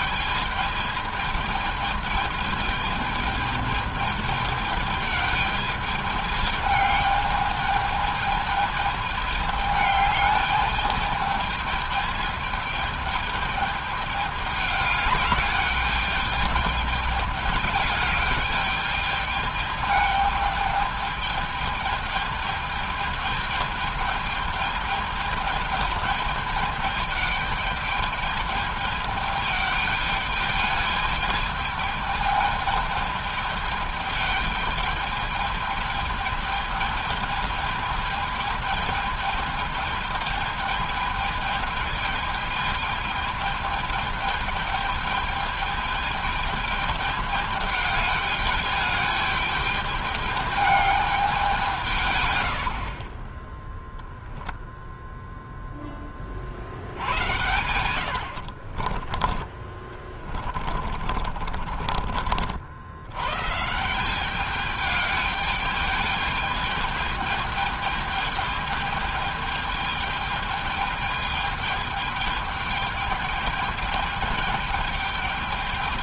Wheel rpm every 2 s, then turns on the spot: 220, 220, 210, 210, 220, 210, 210, 210, 210, 210, 210, 210, 210, 210, 210, 220, 210, 210, 210, 210, 210, 210, 210, 210, 210, 200, 30, 0, 80, 20, 40, 110, 210, 210, 210, 210, 210, 210.
56-62